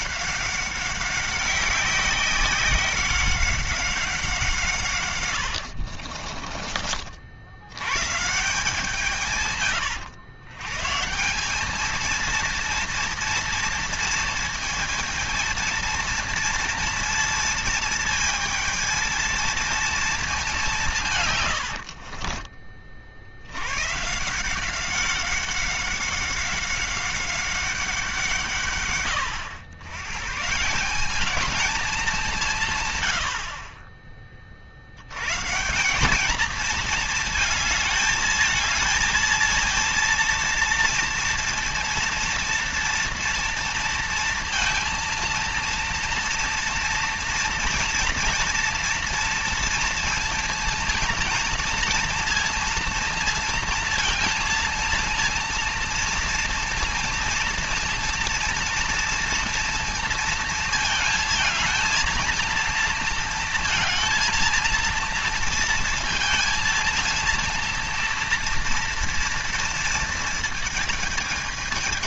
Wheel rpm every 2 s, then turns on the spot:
190, 190, 160, 40, 160, 120, 230, 230, 230, 220, 190, 30, 180, 190, 150, 160, 160, 50, 220, 220, 230, 230, 230, 230, 230, 230, 230, 230, 230, 230, 220, 230, 230, 230, 230, 230.
6-8